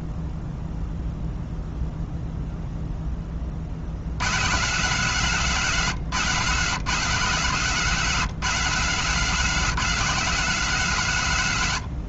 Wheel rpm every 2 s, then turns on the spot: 0, 0, 130, 140, 170, 170.
none